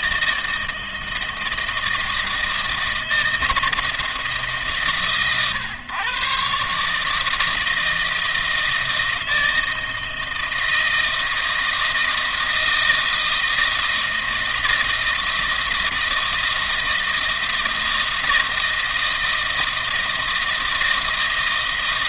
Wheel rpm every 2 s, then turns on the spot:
160, 160, 130, 140, 160, 160, 160, 160, 160, 160, 160.
none